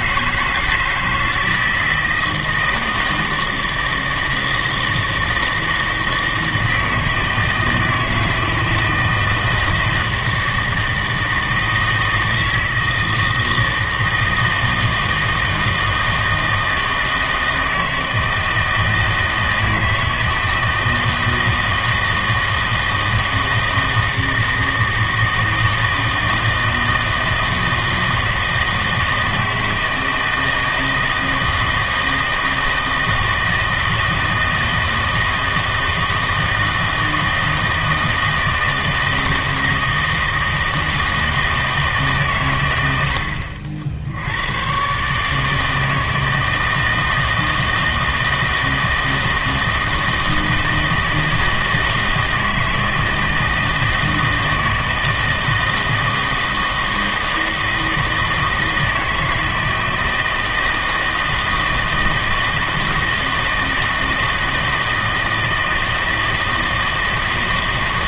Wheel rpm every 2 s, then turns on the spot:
160, 160, 160, 160, 160, 160, 160, 160, 160, 160, 160, 160, 160, 160, 160, 160, 160, 160, 160, 160, 160, 100, 110, 160, 160, 160, 160, 160, 160, 160, 160, 160, 160, 160.
none